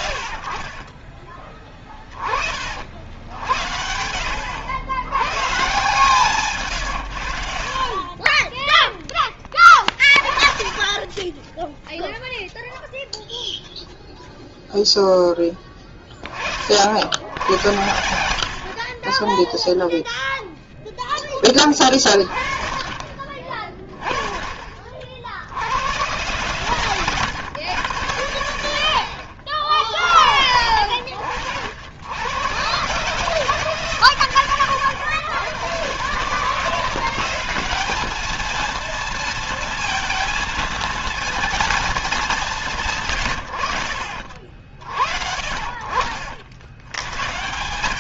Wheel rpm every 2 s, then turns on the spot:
30, 50, 100, 110, 10, 20, 0, 0, 60, 40, 0, 30, 50, 120, 90, 70, 120, 120, 170, 230, 230, 170, 50, 90.
none